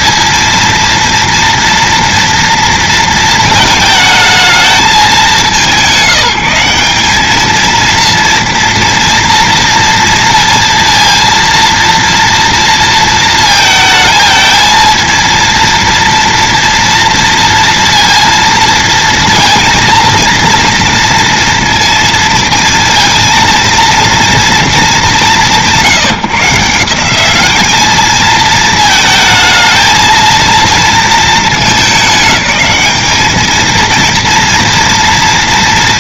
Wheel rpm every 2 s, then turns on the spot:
220, 230, 220, 180, 230, 230, 230, 220, 230, 230, 240, 230, 200, 170, 220, 230, 210, 230.
none